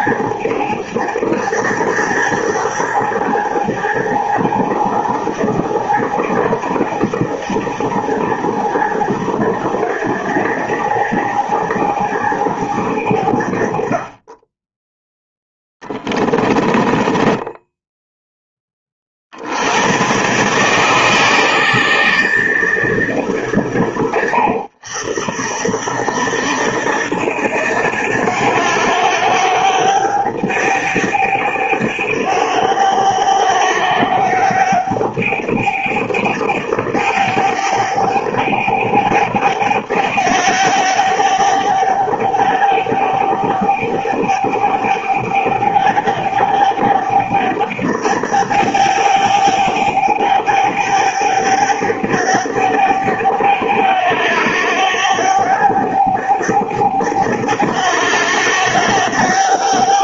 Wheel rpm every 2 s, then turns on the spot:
110, 110, 110, 110, 110, 100, 100, 20, 20, 20, 140, 150, 70, 70, 100, 100, 100, 100, 100, 100, 100, 100, 100, 100, 100, 100, 100, 100, 100, 100.
16-18